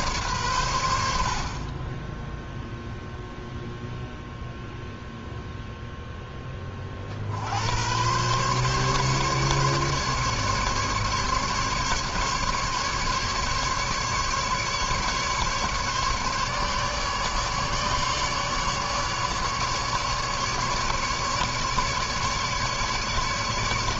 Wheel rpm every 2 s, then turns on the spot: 120, 0, 0, 10, 130, 150, 150, 140, 150, 150, 150, 150.
none